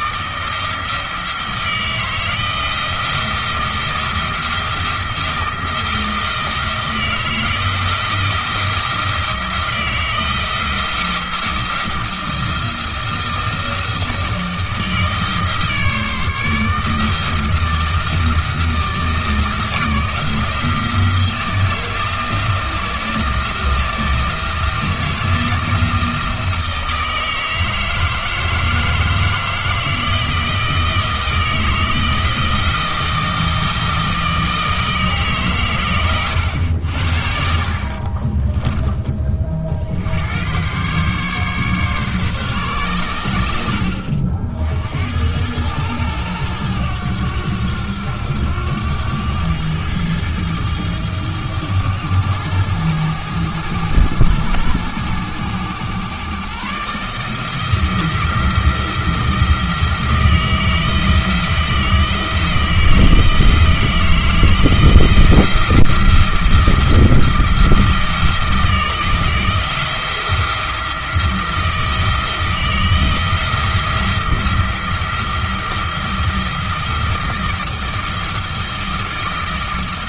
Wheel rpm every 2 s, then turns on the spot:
160, 170, 170, 160, 170, 170, 170, 160, 160, 160, 170, 170, 160, 160, 160, 160, 160, 160, 80, 10, 120, 120, 70, 100, 100, 100, 100, 100, 140, 160, 160, 170, 170, 170, 160, 170, 160, 170, 170, 160.
none